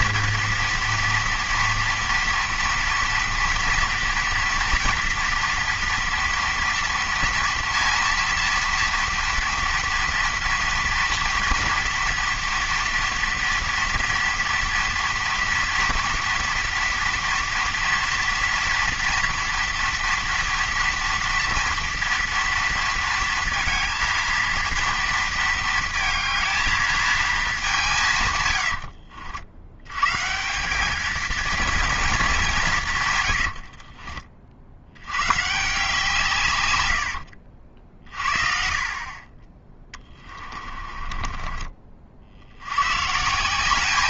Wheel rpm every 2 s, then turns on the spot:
230, 230, 230, 230, 230, 230, 230, 230, 230, 230, 230, 230, 230, 220, 90, 180, 170, 60, 110, 40, 30, 90.
40-42